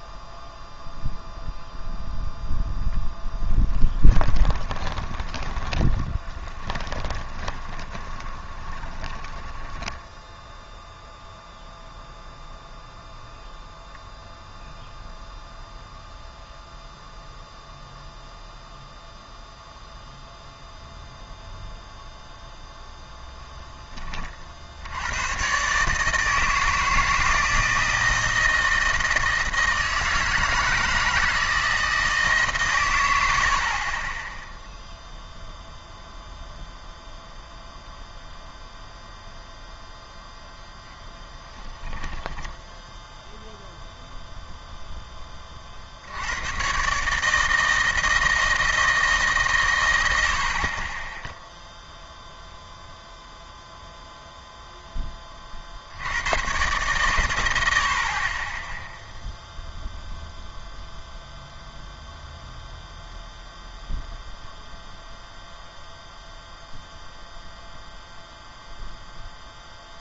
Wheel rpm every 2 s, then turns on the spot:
0, 0, 20, 20, 20, 0, 0, 0, 0, 0, 0, 0, 60, 160, 160, 160, 130, 0, 0, 0, 0, 10, 0, 110, 160, 40, 0, 0, 110, 20, 0, 0, 0, 0, 0.
4-10 42-44